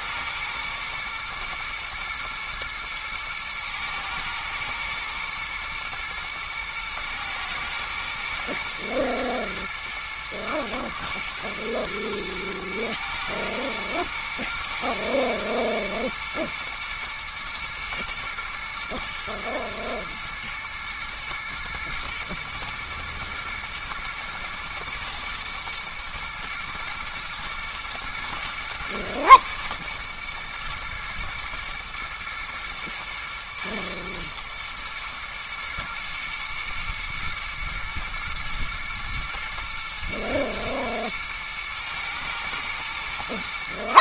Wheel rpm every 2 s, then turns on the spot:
110, 110, 120, 120, 120, 110, 110, 120, 110, 120, 110, 110, 110, 120, 110, 110, 110, 110, 120, 110, 110, 110.
none